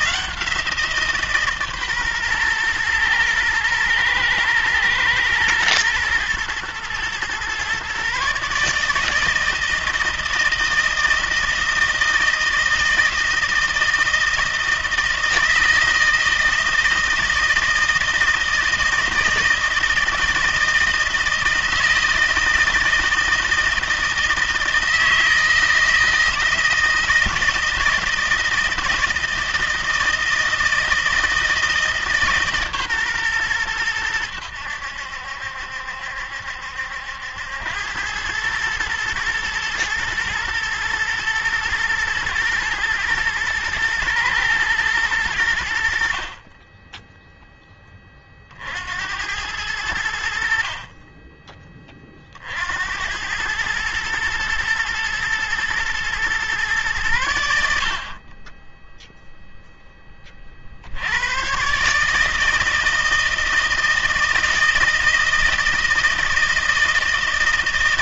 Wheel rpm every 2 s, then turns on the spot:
170, 120, 110, 120, 150, 160, 160, 160, 160, 160, 160, 160, 160, 160, 160, 160, 150, 90, 70, 110, 120, 120, 110, 30, 40, 60, 60, 110, 120, 30, 40, 150, 160, 160.
none